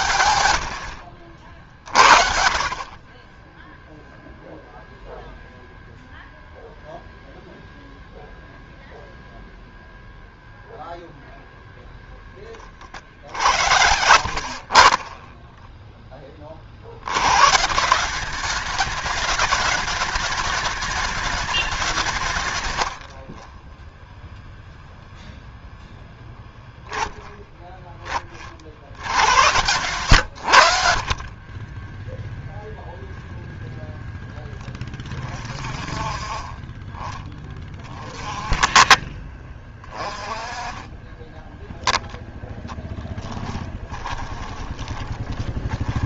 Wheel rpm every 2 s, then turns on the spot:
80, 40, 0, 0, 0, 10, 30, 50, 50, 210, 210, 110, 0, 10, 60, 80, 0, 20, 30, 30, 20, 10, 20.
12-14 44-46